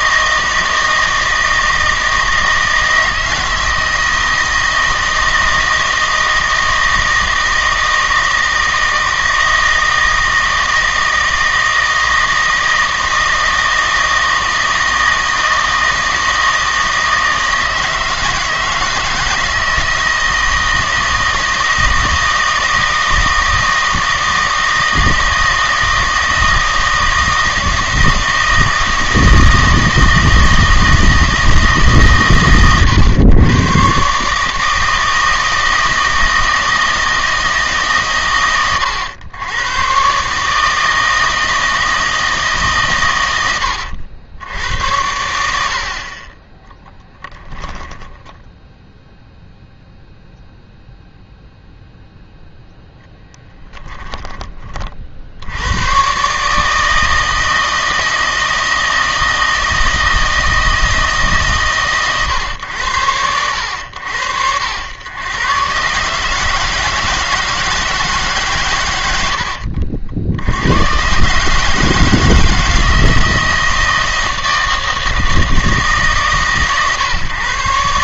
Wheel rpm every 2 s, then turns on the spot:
160, 160, 160, 160, 160, 160, 160, 160, 160, 160, 160, 160, 160, 160, 160, 160, 120, 150, 160, 110, 150, 150, 80, 20, 10, 0, 0, 40, 150, 160, 160, 110, 80, 150, 130, 90, 160, 160, 140.
46-48